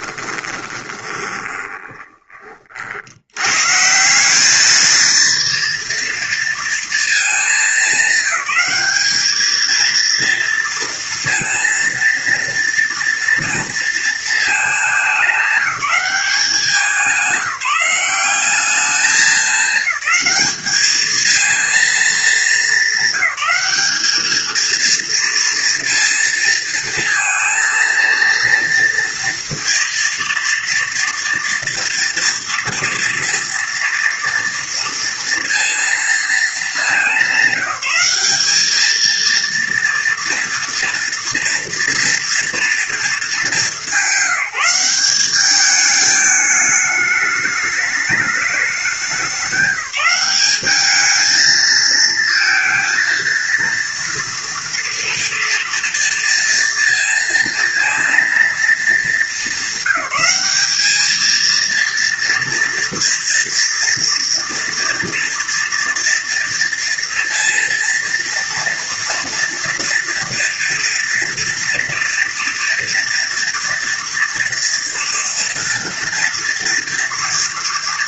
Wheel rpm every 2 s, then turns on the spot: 30, 40, 210, 230, 210, 230, 230, 220, 190, 200, 210, 220, 230, 230, 230, 230, 230, 230, 220, 210, 230, 230, 190, 210, 210, 210, 230, 230, 230, 220, 200, 230, 230, 230, 230, 230, 230, 230, 230.
0-2